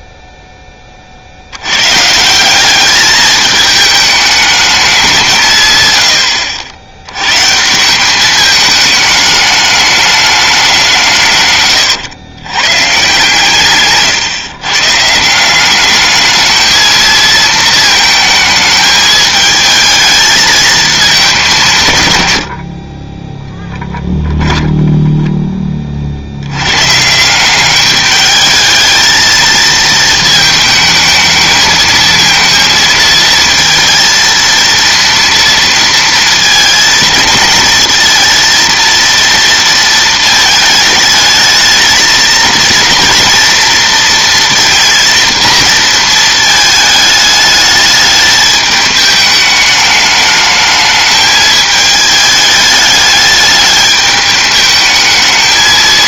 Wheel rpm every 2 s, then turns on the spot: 10, 190, 210, 80, 210, 190, 110, 140, 220, 220, 220, 70, 10, 100, 220, 220, 230, 230, 220, 230, 220, 230, 230, 220, 210, 210, 210, 210.
24-26